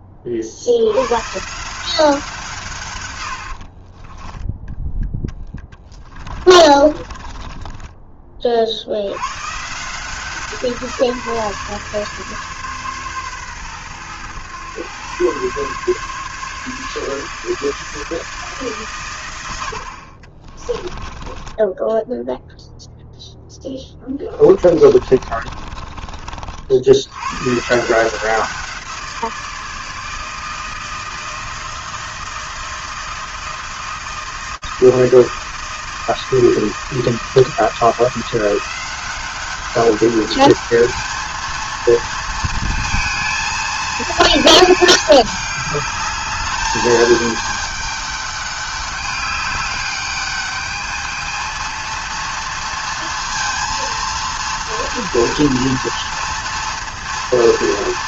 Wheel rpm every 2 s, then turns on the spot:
50, 150, 10, 30, 40, 170, 140, 120, 150, 140, 20, 0, 20, 70, 170, 160, 160, 160, 160, 180, 210, 230, 220, 210, 200, 210, 230, 230, 230.
6-8 20-22 24-26